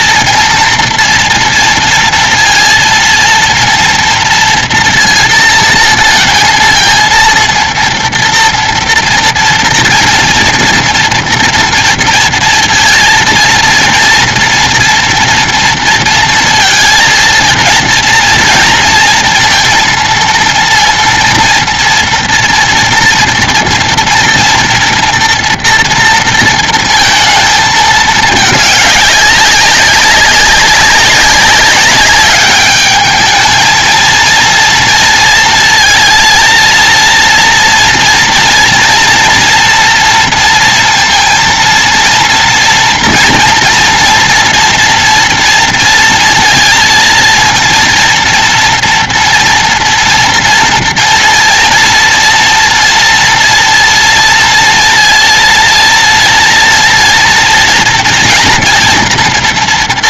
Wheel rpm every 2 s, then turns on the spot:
230, 230, 230, 230, 230, 230, 230, 230, 230, 230, 230, 230, 230, 230, 220, 200, 200, 230, 230, 240, 230, 230, 240, 230, 230, 230, 230, 230, 230, 230.
none